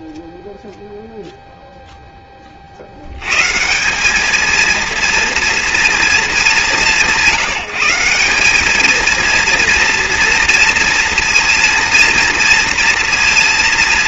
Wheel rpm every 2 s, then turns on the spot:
0, 110, 230, 150, 230, 230, 230.
none